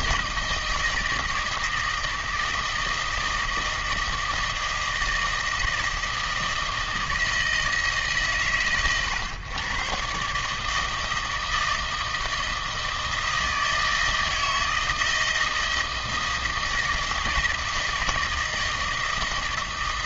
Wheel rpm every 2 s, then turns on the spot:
160, 160, 160, 160, 110, 150, 160, 160, 160, 160.
none